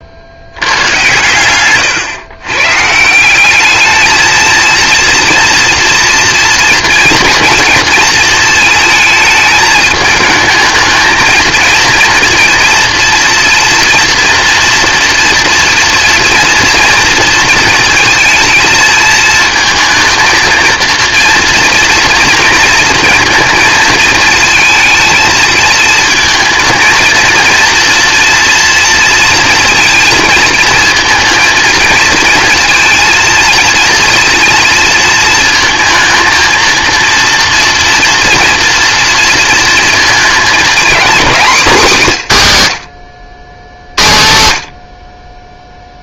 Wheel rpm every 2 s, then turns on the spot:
100, 140, 230, 230, 220, 220, 230, 230, 230, 230, 230, 230, 230, 230, 230, 230, 230, 230, 230, 240, 230, 120, 80.
none